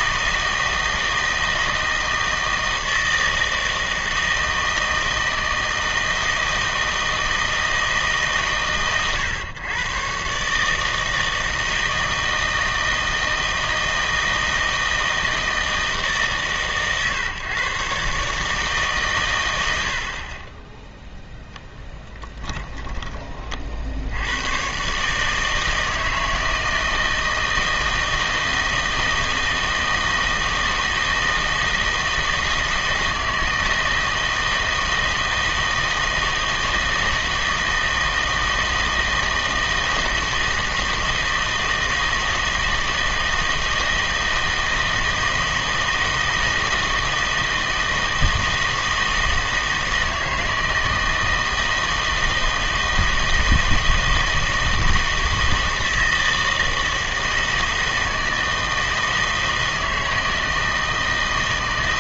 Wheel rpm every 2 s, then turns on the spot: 160, 160, 160, 160, 130, 150, 160, 160, 140, 150, 10, 10, 130, 160, 160, 160, 160, 160, 160, 160, 160, 160, 160, 160, 160, 160, 160, 160, 160, 160, 160.
none